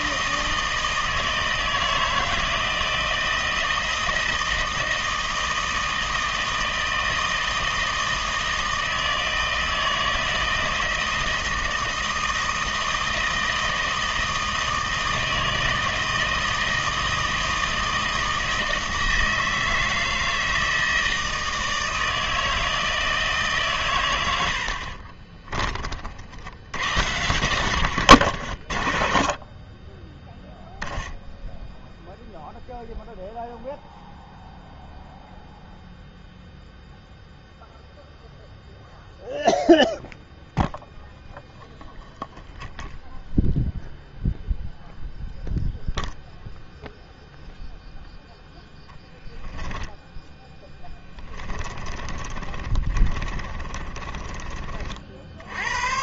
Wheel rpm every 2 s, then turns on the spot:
160, 160, 160, 160, 160, 170, 160, 160, 160, 160, 160, 160, 60, 90, 80, 10, 0, 0, 0, 0, 0, 0, 0, 0, 0, 10, 30, 30.
24-26 50-54